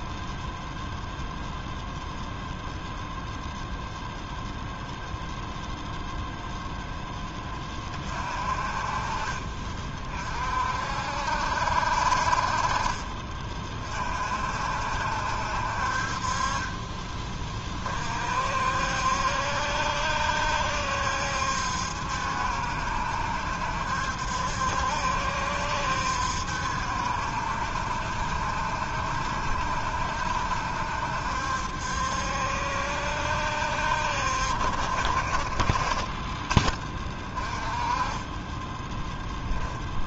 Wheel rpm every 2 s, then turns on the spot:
0, 0, 0, 0, 30, 50, 50, 60, 30, 60, 70, 70, 70, 70, 70, 70, 70, 50, 20, 10.
16-18